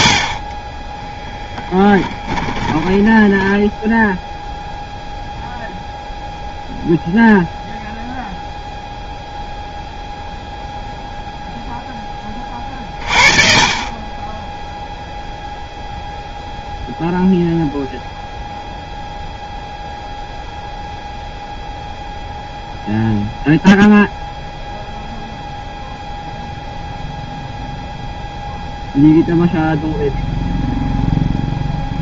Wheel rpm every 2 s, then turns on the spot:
30, 10, 0, 0, 0, 0, 30, 10, 0, 0, 0, 0, 0, 0, 0, 0.
0-4